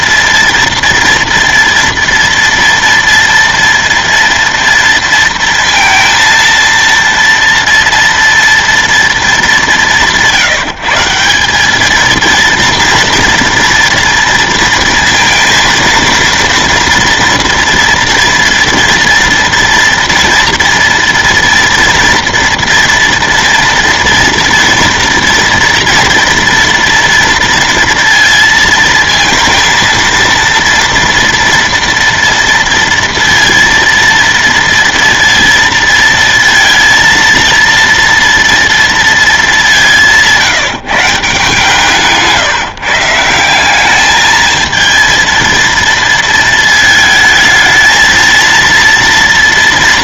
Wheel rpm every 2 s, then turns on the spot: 230, 230, 230, 230, 230, 160, 230, 230, 230, 230, 230, 230, 240, 240, 230, 230, 230, 230, 230, 230, 170, 160, 220, 220, 230.
none